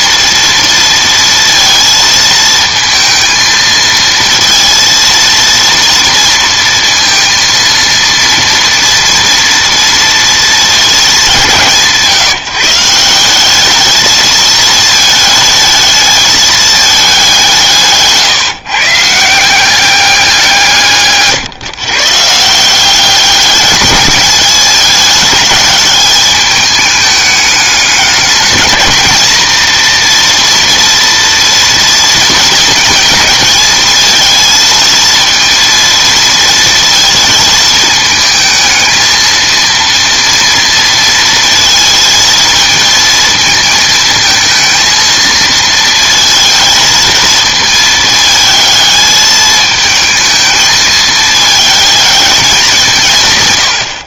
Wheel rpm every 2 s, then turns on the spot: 230, 230, 230, 230, 230, 220, 160, 220, 210, 140, 180, 170, 210, 210, 210, 230, 220, 220, 230, 220, 230, 230, 220, 220, 220, 220, 190.
none